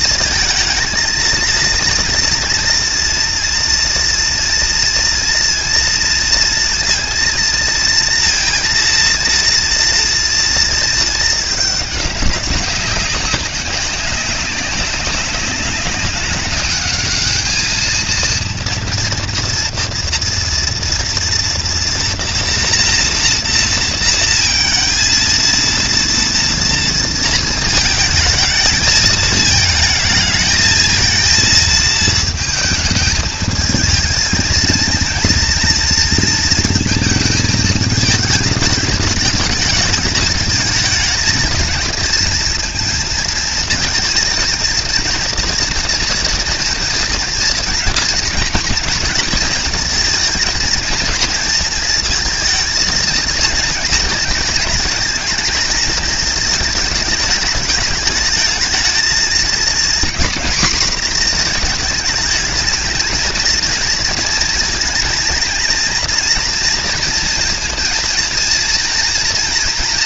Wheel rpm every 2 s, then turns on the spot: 220, 230, 240, 230, 230, 230, 200, 190, 200, 230, 240, 230, 230, 230, 220, 220, 220, 230, 230, 220, 220, 230, 230, 230, 230, 220, 220, 220, 220, 220, 240, 220, 230, 230, 230.
none